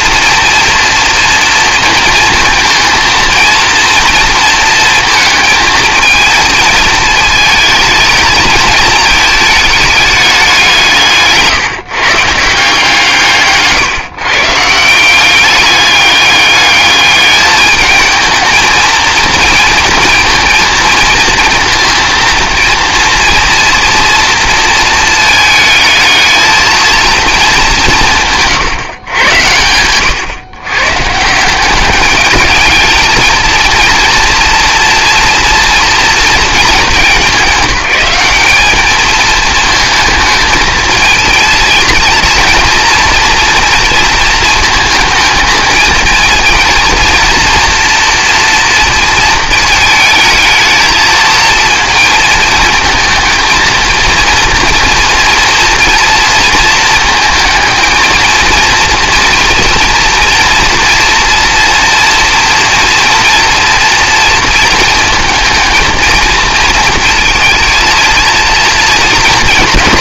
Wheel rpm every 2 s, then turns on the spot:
240, 230, 230, 220, 220, 190, 160, 170, 210, 220, 230, 230, 230, 230, 150, 130, 210, 230, 220, 210, 220, 230, 230, 230, 230, 220, 220, 230, 230, 230, 230, 230, 230, 220, 220.
none